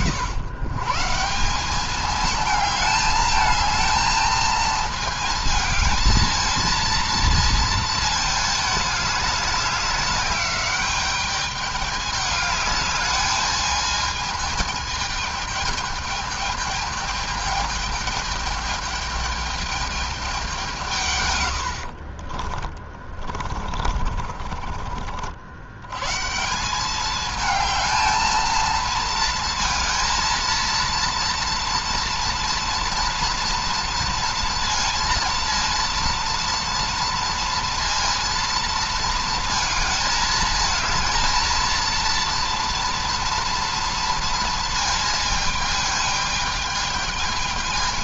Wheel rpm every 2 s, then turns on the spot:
150, 220, 220, 230, 210, 210, 210, 220, 210, 210, 160, 30, 50, 200, 220, 230, 230, 230, 230, 230, 230, 230, 220, 220.
22-24